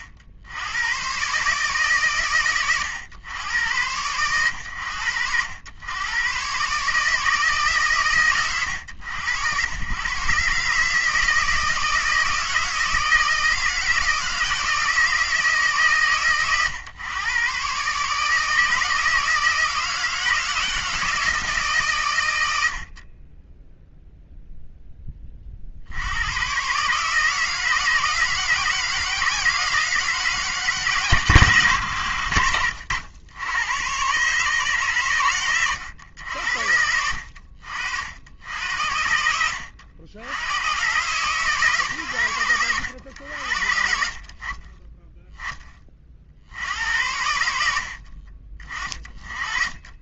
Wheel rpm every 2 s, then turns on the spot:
80, 100, 100, 140, 90, 140, 160, 170, 110, 160, 160, 80, 0, 120, 160, 140, 70, 140, 70, 70, 110, 110, 40, 60, 30.
none